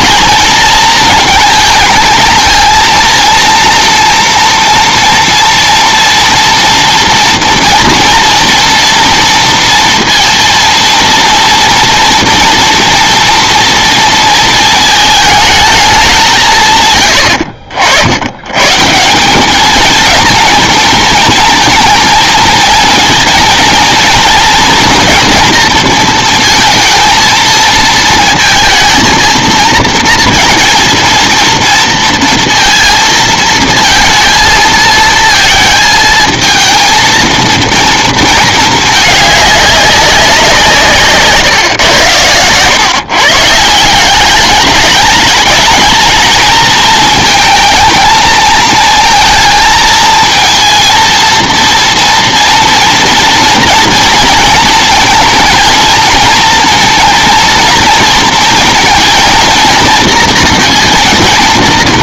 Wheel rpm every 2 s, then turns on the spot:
230, 230, 240, 230, 230, 230, 230, 220, 130, 150, 220, 230, 230, 220, 230, 230, 230, 230, 230, 210, 170, 130, 210, 220, 220, 230, 230, 230, 230, 230, 230.
none